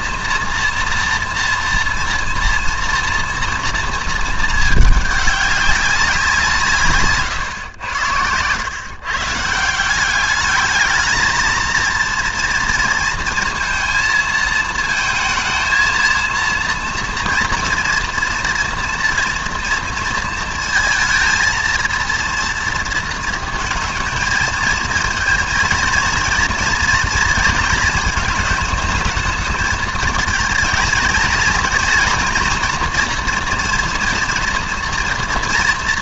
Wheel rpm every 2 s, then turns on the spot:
230, 230, 210, 150, 130, 220, 230, 220, 230, 240, 230, 230, 230, 240, 220, 230, 240, 230.
none